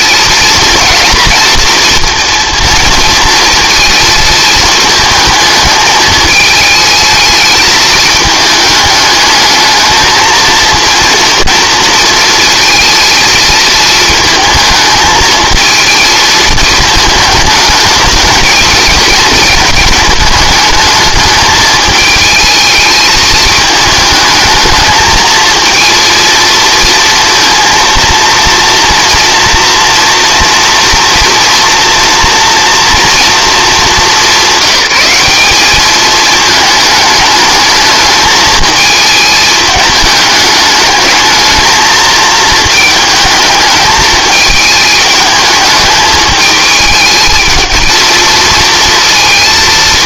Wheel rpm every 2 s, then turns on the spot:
240, 230, 220, 220, 210, 230, 230, 220, 220, 230, 220, 220, 220, 230, 230, 230, 230, 200, 220, 220, 210, 220, 220, 220, 230.
none